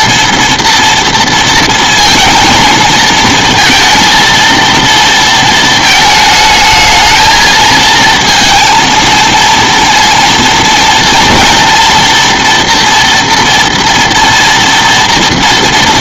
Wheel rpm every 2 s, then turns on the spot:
230, 220, 230, 220, 230, 230, 230, 230.
none